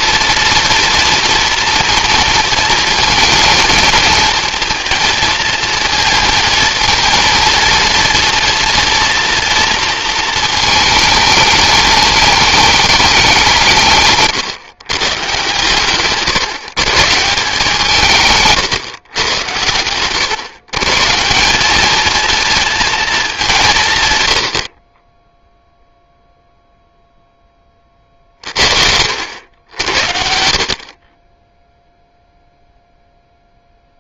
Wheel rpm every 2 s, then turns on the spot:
230, 230, 230, 230, 230, 220, 210, 140, 140, 150, 140, 230, 70, 0, 50, 60, 0.
18-20